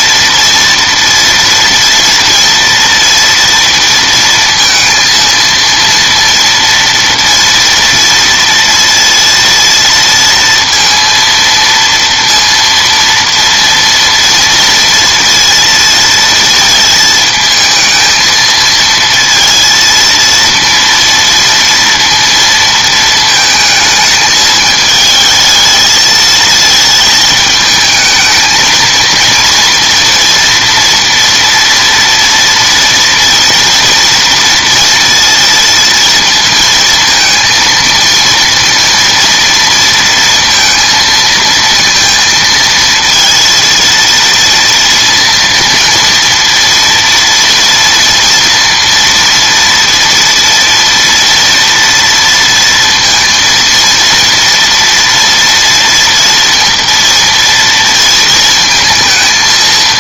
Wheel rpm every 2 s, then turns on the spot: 230, 230, 230, 230, 230, 230, 230, 230, 220, 220, 230, 230, 220, 220, 230, 240, 230, 230, 220, 230, 230, 230, 230, 230, 230, 230, 230, 230, 230, 230.
none